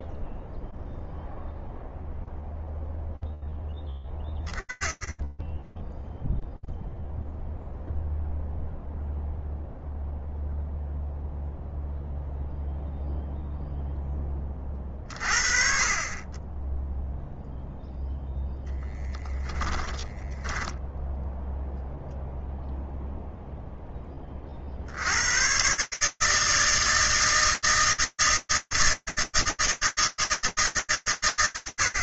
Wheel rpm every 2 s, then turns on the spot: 0, 0, 30, 0, 0, 0, 0, 20, 20, 0, 10, 0, 20, 150, 160, 160.
20-22